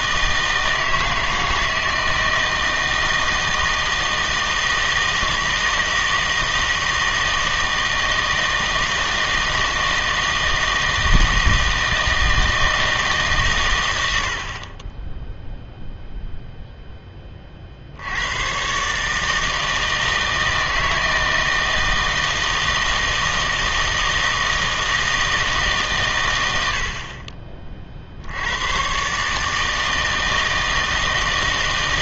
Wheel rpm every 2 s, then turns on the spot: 160, 160, 160, 160, 160, 160, 160, 30, 0, 120, 160, 160, 160, 80, 100, 160.
none